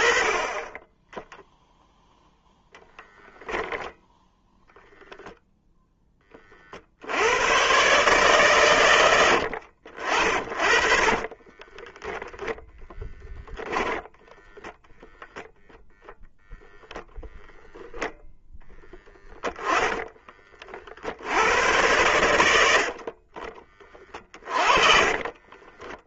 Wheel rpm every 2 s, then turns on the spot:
10, 0, 0, 70, 100, 30, 10, 0, 0, 10, 60, 50, 30.
10-12 24-26